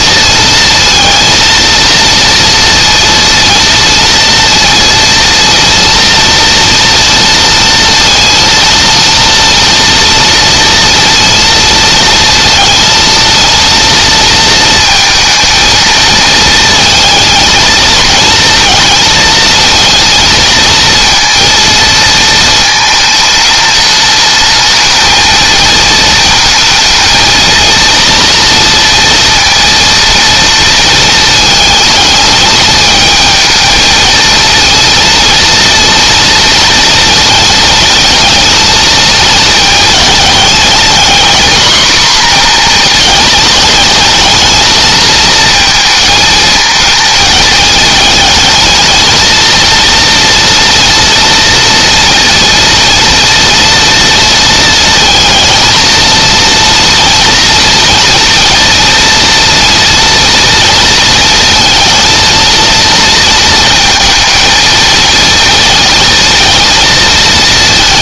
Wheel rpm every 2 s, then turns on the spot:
230, 230, 230, 230, 230, 230, 230, 220, 230, 230, 230, 220, 220, 230, 230, 230, 210, 230, 230, 220, 240, 230, 220, 230, 220, 240, 230, 230, 230, 230, 230, 230, 230, 220.
none